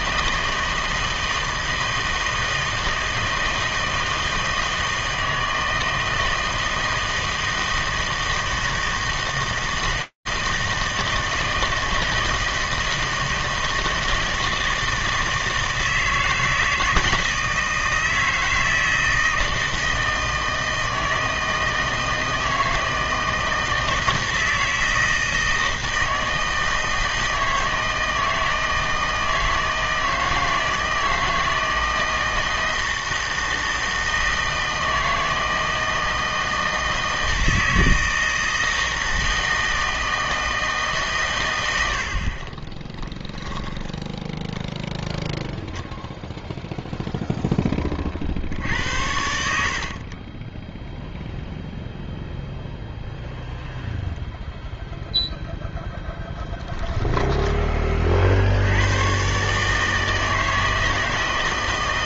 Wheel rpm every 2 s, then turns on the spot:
160, 160, 160, 160, 160, 160, 160, 160, 160, 160, 160, 160, 160, 160, 160, 160, 160, 160, 160, 160, 160, 30, 10, 0, 70, 10, 0, 0, 10, 80, 160.
42-44